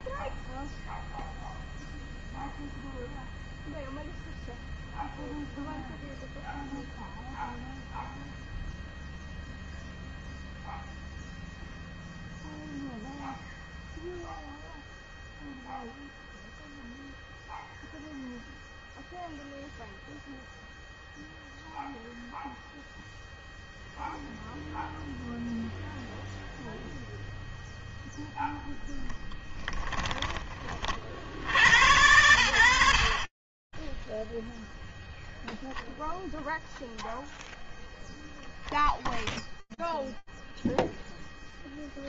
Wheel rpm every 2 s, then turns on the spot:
0, 0, 0, 0, 0, 0, 0, 0, 0, 0, 0, 0, 0, 0, 0, 20, 80, 0, 0, 0, 0.
none